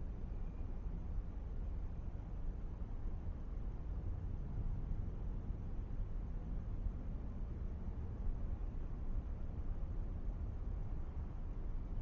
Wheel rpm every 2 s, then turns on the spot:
0, 0, 0, 0, 0, 0.
none